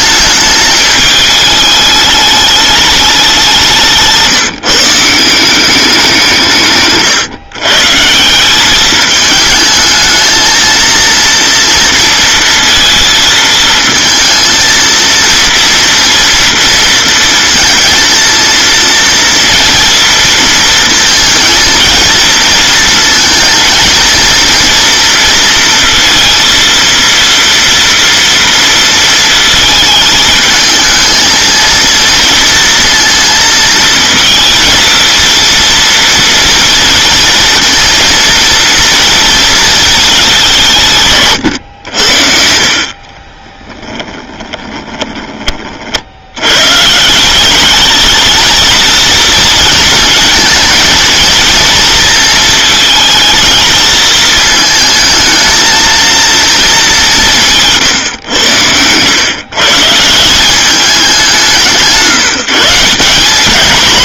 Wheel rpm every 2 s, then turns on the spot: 220, 210, 160, 150, 200, 230, 230, 230, 230, 230, 230, 230, 230, 230, 230, 220, 230, 230, 230, 230, 170, 50, 20, 120, 230, 230, 230, 220, 220, 100, 190, 160.
44-46